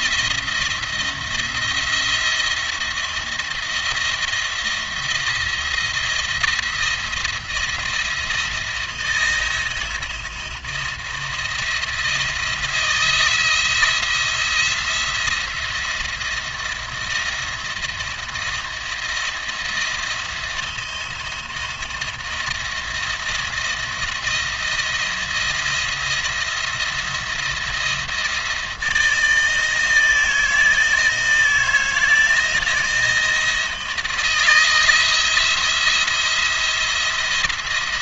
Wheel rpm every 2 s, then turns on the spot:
170, 170, 170, 160, 160, 170, 170, 170, 170, 170, 170, 170, 170, 170, 160, 160, 170, 160, 170.
none